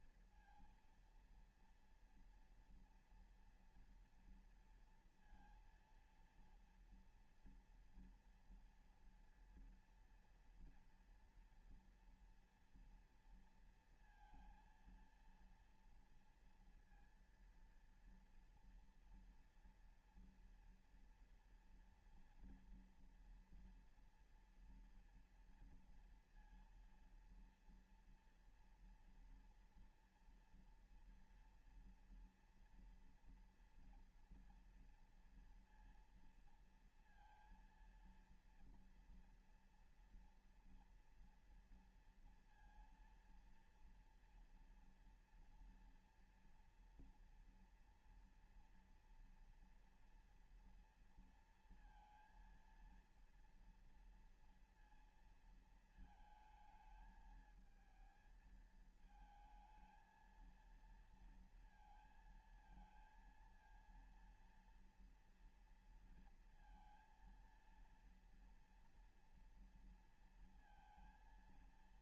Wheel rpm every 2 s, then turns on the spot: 230, 230, 230, 230, 230, 230, 230, 230, 230, 240, 230, 230, 230, 230, 230, 230, 230, 230, 230, 240, 240, 230, 230, 230, 230, 230, 230, 230, 220, 220, 230, 230, 230, 230, 230, 230.
none